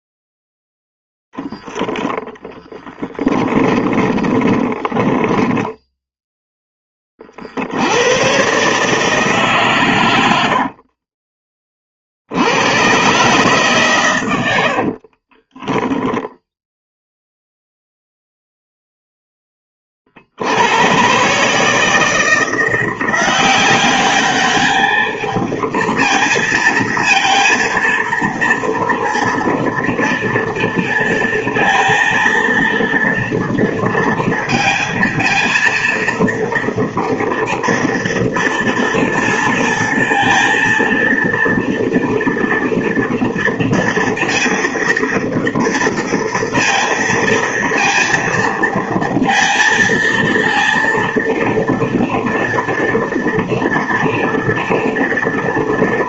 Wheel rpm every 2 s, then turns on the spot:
0, 10, 10, 10, 140, 60, 110, 70, 0, 0, 100, 170, 210, 230, 230, 230, 230, 230, 230, 230, 230, 230, 230, 230, 230, 230, 230, 230.
2-6 10-12 14-16